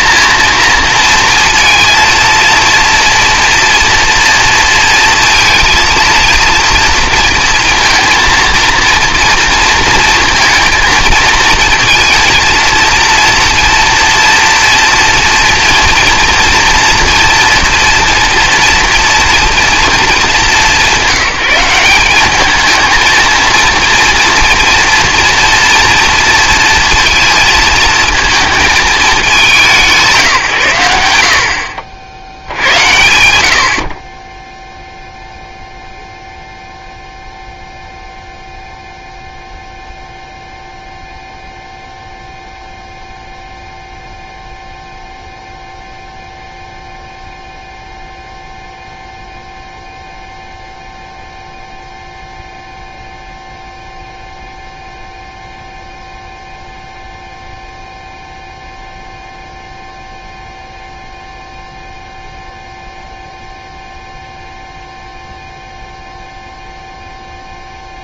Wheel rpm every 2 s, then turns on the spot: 230, 230, 230, 230, 230, 230, 230, 230, 240, 240, 200, 210, 230, 230, 220, 120, 90, 0, 0, 0, 0, 0, 0, 0, 0, 0, 0, 0, 0, 0, 0, 0, 0, 0.
none